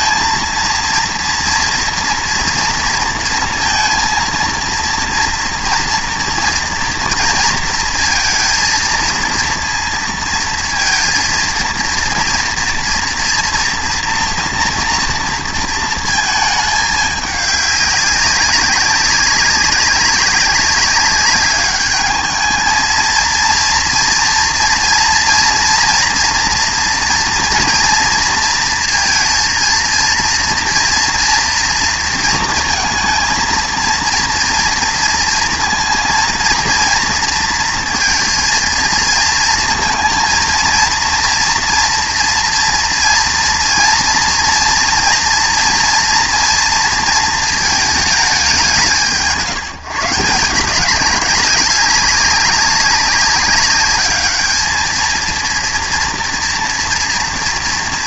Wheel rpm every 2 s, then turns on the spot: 230, 230, 230, 230, 230, 230, 230, 230, 210, 200, 200, 220, 230, 230, 230, 230, 230, 230, 230, 230, 230, 230, 230, 230, 190, 180, 200, 220, 230.
none